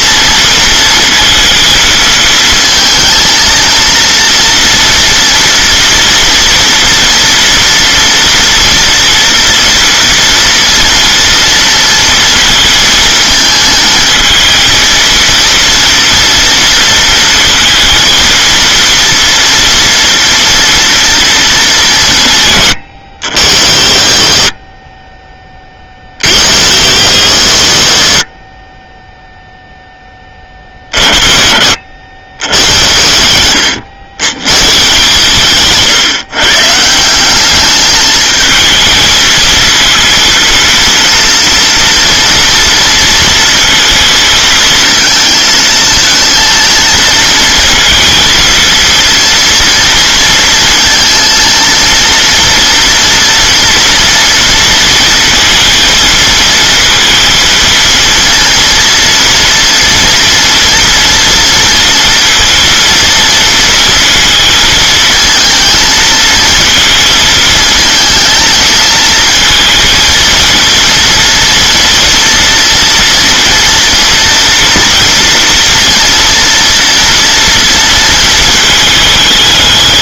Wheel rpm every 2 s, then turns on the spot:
230, 220, 230, 230, 240, 230, 220, 230, 230, 230, 230, 100, 20, 90, 20, 30, 70, 150, 160, 220, 230, 230, 230, 220, 230, 230, 230, 230, 230, 230, 230, 230, 220, 220, 220, 230, 230, 230, 230, 210.
none